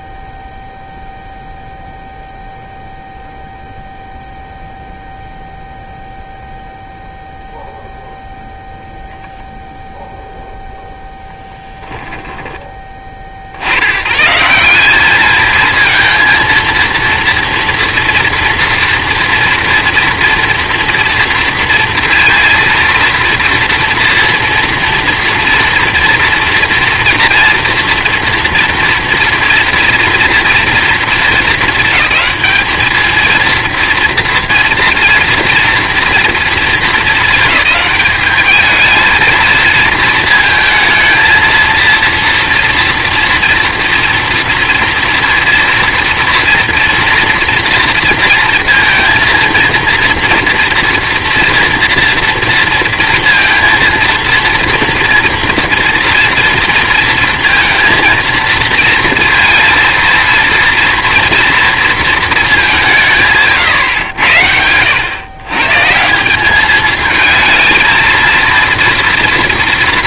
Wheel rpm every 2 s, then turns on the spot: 0, 0, 0, 0, 0, 0, 20, 190, 230, 230, 230, 230, 230, 230, 230, 230, 220, 230, 220, 220, 230, 230, 230, 230, 230, 230, 230, 230, 230, 230, 240, 200, 90, 210, 230.
none